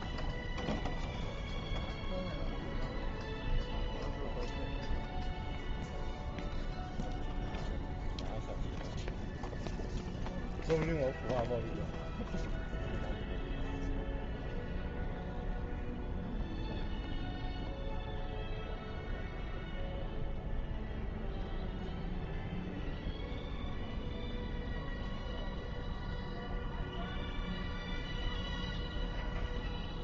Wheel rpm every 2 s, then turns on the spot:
0, 0, 0, 0, 0, 0, 0, 0, 0, 0, 0, 0, 0, 0, 0.
none